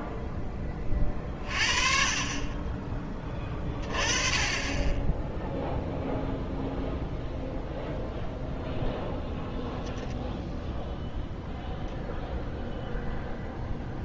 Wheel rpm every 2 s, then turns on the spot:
20, 20, 10, 0, 0, 0, 0.
none